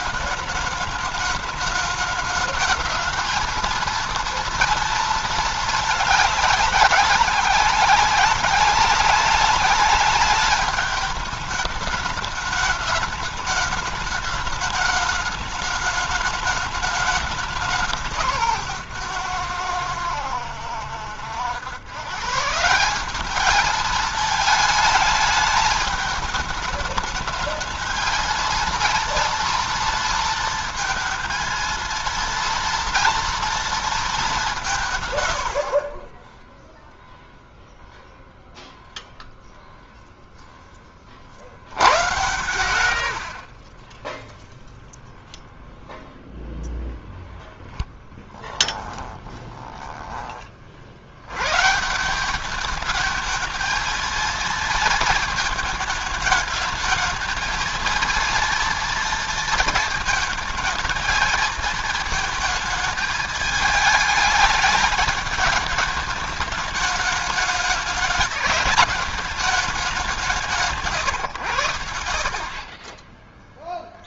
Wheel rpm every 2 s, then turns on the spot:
210, 220, 230, 200, 190, 200, 210, 210, 210, 150, 90, 150, 220, 210, 230, 230, 230, 170, 10, 0, 10, 110, 0, 0, 10, 30, 210, 230, 220, 230, 220, 220, 220, 210, 210, 180, 40.
48-50 72-74